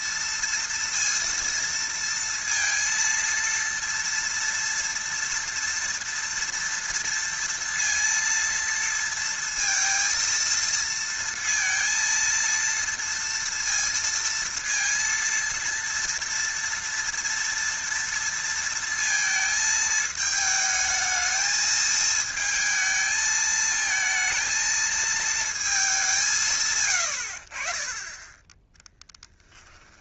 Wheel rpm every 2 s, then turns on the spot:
230, 230, 230, 230, 230, 230, 230, 230, 230, 230, 220, 220, 220, 130, 10.
26-28